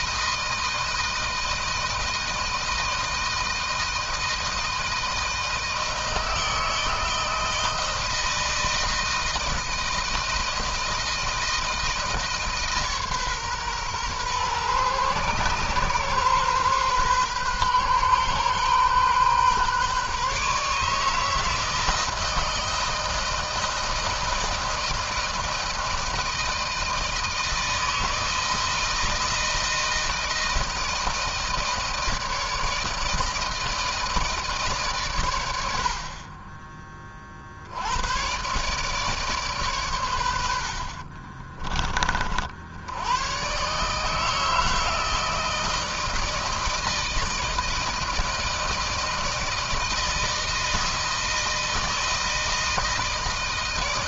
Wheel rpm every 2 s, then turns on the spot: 160, 160, 160, 160, 160, 160, 150, 120, 130, 130, 150, 160, 160, 160, 160, 160, 160, 130, 30, 140, 50, 90, 160, 160, 160, 160, 160.
none